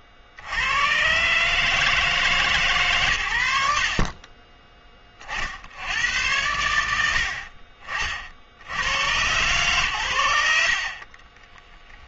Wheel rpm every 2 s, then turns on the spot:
70, 150, 20, 90, 80, 30.
10-12